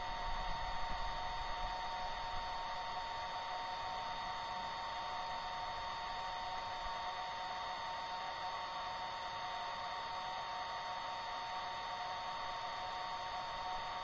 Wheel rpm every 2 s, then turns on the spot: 0, 0, 0, 0, 0, 0, 0.
none